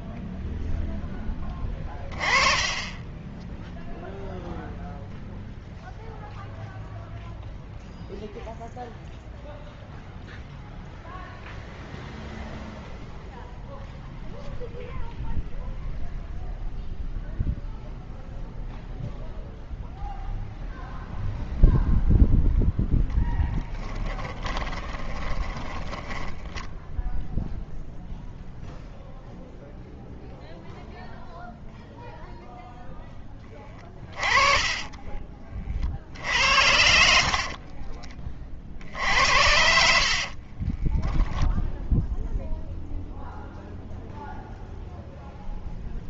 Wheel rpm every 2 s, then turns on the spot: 0, 20, 0, 0, 0, 0, 0, 0, 0, 0, 0, 10, 20, 0, 0, 0, 0, 30, 60, 50, 40, 0, 0.
24-26 34-36 40-42